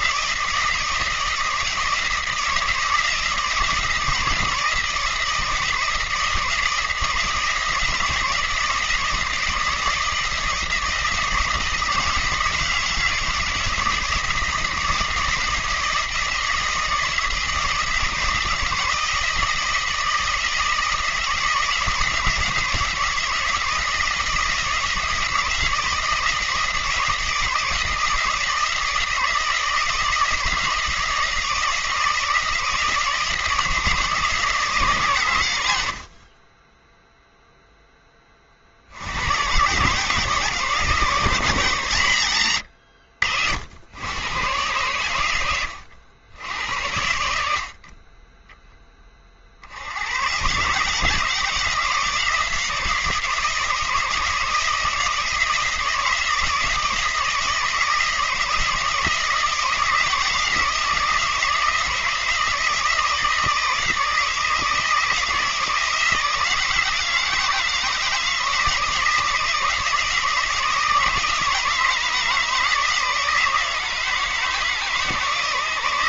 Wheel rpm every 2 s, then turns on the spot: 160, 160, 160, 160, 160, 160, 160, 160, 160, 170, 160, 160, 160, 160, 160, 170, 170, 150, 20, 50, 150, 90, 120, 90, 10, 140, 160, 160, 160, 160, 160, 160, 160, 170, 160, 160, 160, 160.
none